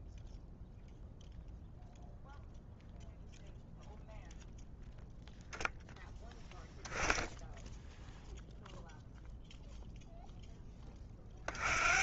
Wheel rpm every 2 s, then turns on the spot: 0, 0, 0, 0, 0, 20.
none